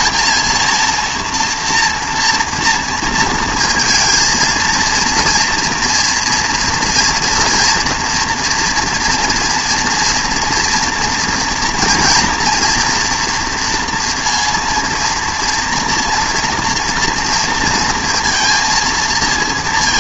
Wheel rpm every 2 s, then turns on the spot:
230, 230, 230, 230, 230, 230, 240, 230, 240, 230.
none